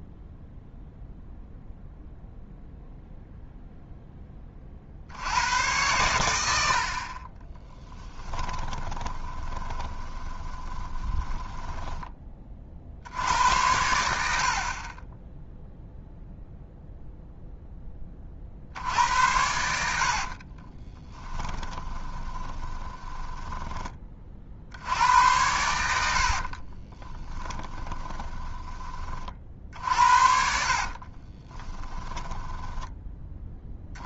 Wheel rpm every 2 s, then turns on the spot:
0, 0, 50, 60, 20, 20, 40, 40, 0, 70, 30, 20, 70, 40, 20, 40, 10.
8-12 20-24 26-28 30-32